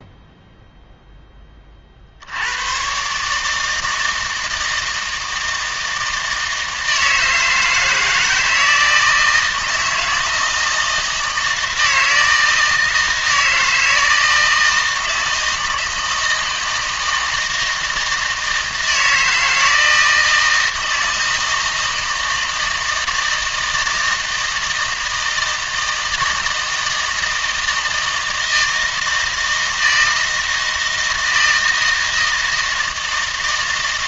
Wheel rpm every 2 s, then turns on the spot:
0, 100, 160, 160, 160, 160, 160, 160, 160, 160, 160, 160, 160, 160, 160, 160, 160.
none